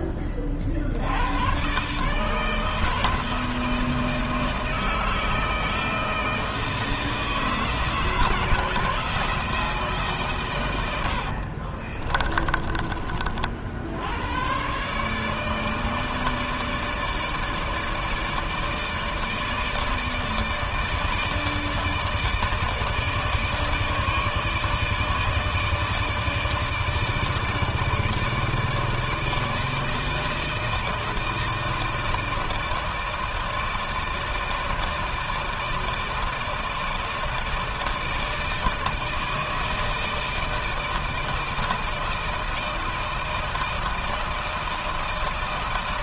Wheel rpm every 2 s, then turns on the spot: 70, 160, 160, 160, 160, 100, 40, 130, 150, 160, 150, 150, 150, 150, 160, 160, 160, 160, 160, 160, 160, 160, 160.
10-12